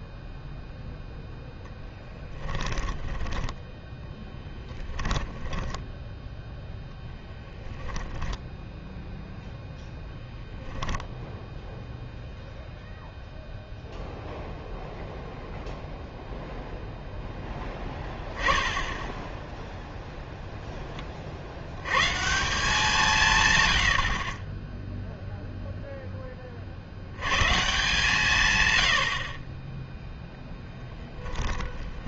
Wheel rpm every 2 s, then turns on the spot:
0, 10, 10, 0, 0, 0, 0, 0, 0, 10, 10, 180, 10, 50, 120, 0.
2-6